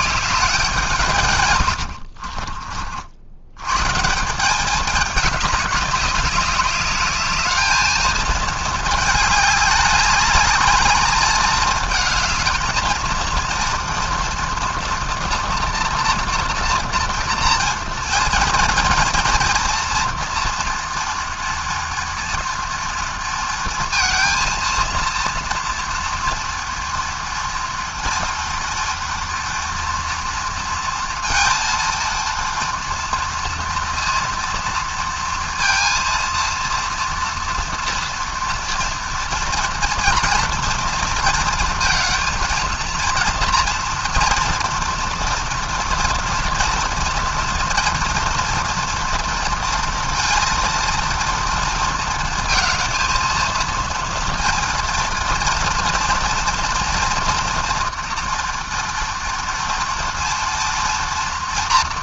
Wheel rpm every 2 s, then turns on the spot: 190, 50, 200, 200, 220, 210, 220, 240, 230, 240, 230, 230, 230, 230, 230, 230, 230, 230, 230, 230, 230, 230, 230, 230, 230, 230, 230, 230, 230, 240, 230.
none